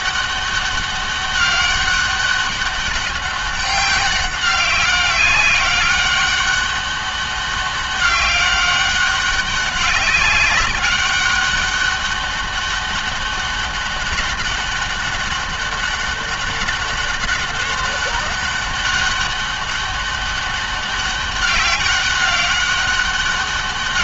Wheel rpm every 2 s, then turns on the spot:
200, 200, 200, 200, 200, 200, 200, 200, 190, 200, 200, 200.
none